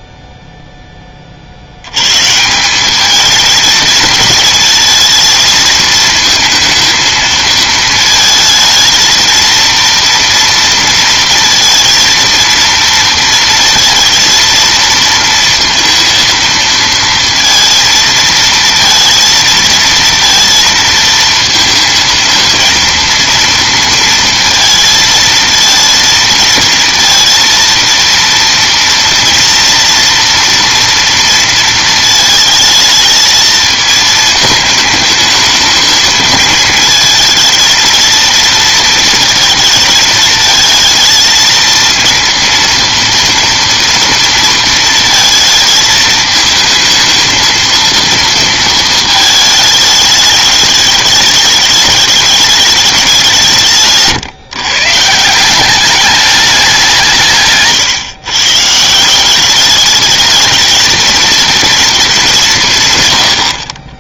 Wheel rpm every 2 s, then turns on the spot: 0, 180, 220, 230, 220, 230, 230, 230, 230, 230, 230, 230, 230, 230, 230, 230, 220, 220, 220, 230, 220, 230, 230, 220, 230, 210, 210, 140, 190, 150, 220, 150.
none